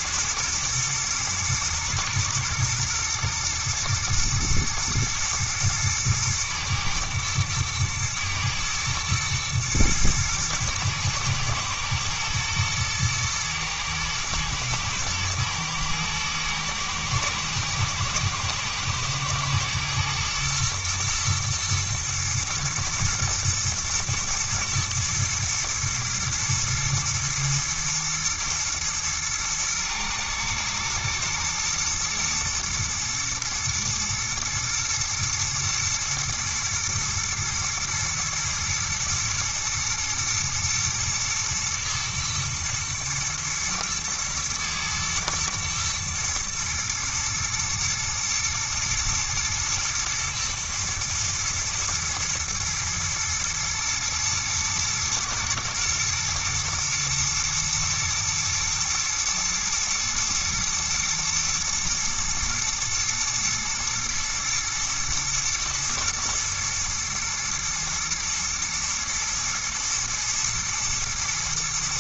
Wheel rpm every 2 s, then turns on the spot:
110, 120, 110, 110, 110, 110, 110, 110, 110, 110, 120, 110, 110, 110, 120, 120, 120, 120, 120, 110, 110, 110, 110, 110, 120, 110, 120, 110, 120, 110, 110, 110, 120, 120, 110, 120.
none